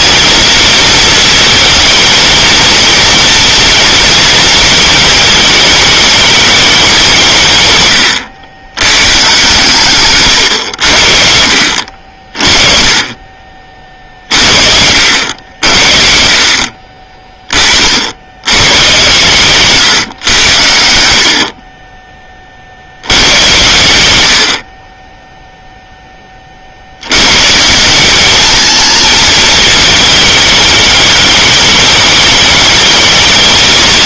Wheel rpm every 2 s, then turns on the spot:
230, 230, 230, 220, 120, 100, 40, 60, 50, 100, 80, 40, 80, 40, 220, 220, 210.
none